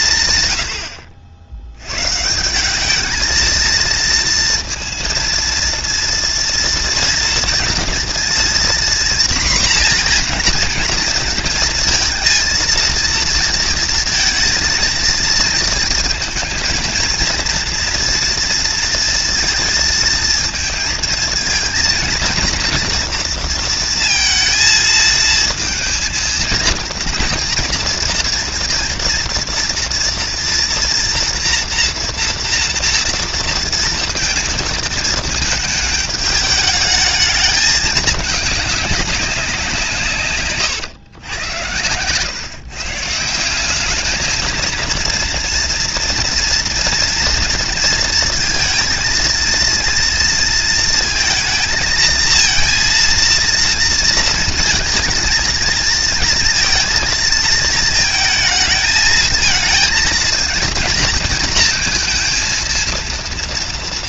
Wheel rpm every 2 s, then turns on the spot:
70, 230, 230, 230, 240, 230, 230, 230, 230, 220, 230, 230, 230, 230, 230, 240, 230, 210, 210, 170, 100, 200, 230, 230, 230, 230, 230, 230, 220, 220, 230, 230.
none